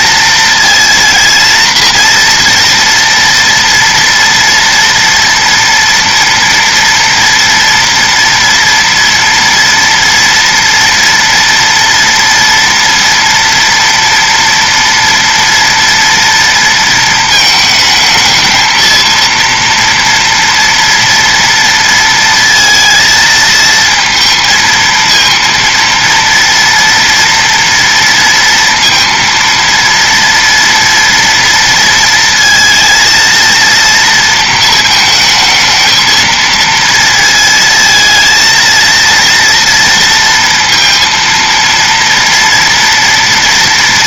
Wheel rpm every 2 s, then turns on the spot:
230, 230, 230, 240, 230, 230, 230, 230, 230, 220, 230, 220, 230, 230, 230, 230, 230, 220, 230, 230, 230, 230.
none